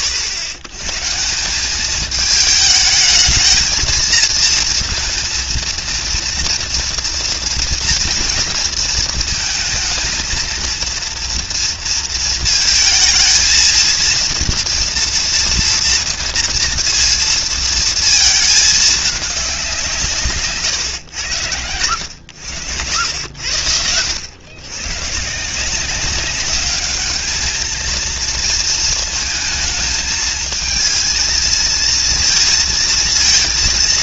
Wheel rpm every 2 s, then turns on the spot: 80, 220, 230, 230, 230, 230, 220, 230, 230, 210, 130, 90, 130, 200, 230, 220, 230.
none